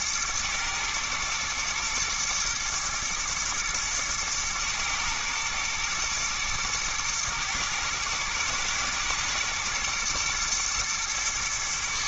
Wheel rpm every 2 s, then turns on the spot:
110, 120, 110, 110, 120, 120.
none